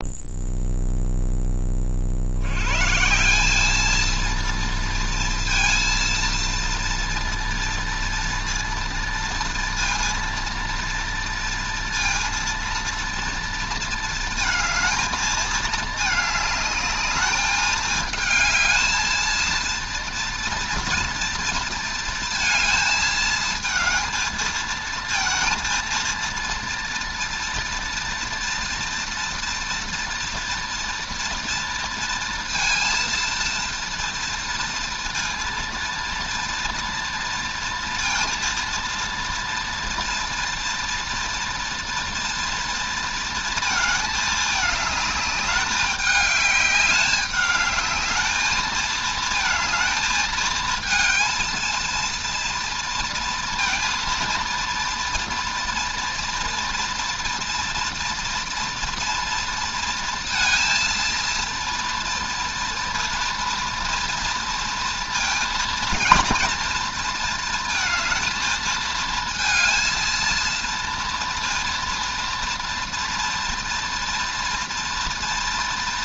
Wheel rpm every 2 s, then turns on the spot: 0, 160, 230, 230, 230, 230, 230, 220, 210, 220, 230, 220, 230, 230, 230, 230, 230, 230, 230, 230, 230, 230, 210, 200, 220, 230, 230, 230, 240, 230, 230, 230, 230, 230, 220, 230, 240, 230.
none